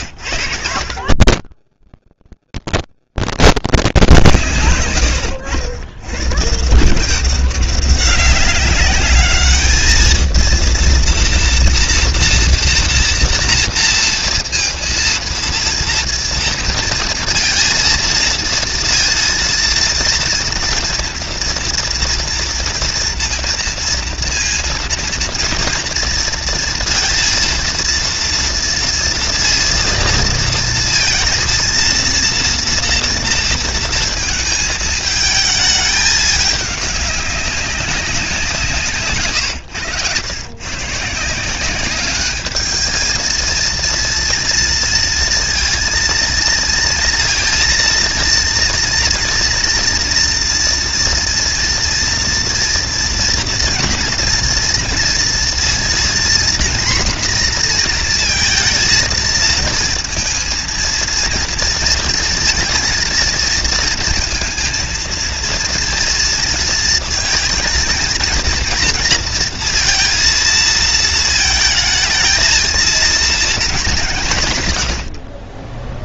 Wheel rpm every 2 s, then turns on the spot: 60, 70, 100, 170, 200, 230, 230, 230, 230, 230, 230, 230, 230, 230, 230, 230, 230, 220, 200, 150, 140, 220, 230, 230, 230, 230, 230, 230, 240, 230, 230, 230, 230, 230, 230, 220, 220, 100.
0-2